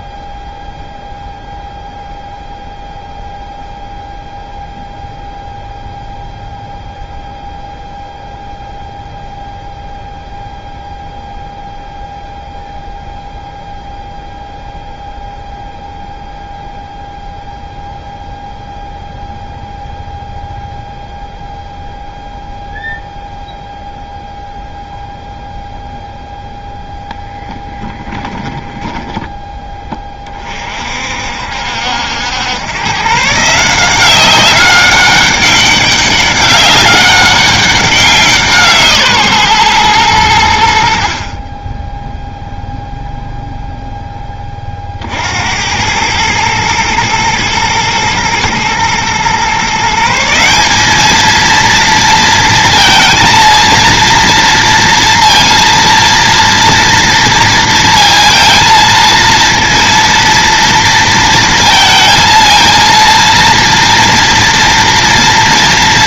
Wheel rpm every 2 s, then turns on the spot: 0, 0, 0, 0, 0, 0, 0, 0, 0, 0, 0, 0, 0, 0, 10, 40, 110, 190, 200, 160, 80, 0, 30, 110, 110, 190, 230, 230, 230, 230, 230, 230, 230.
28-30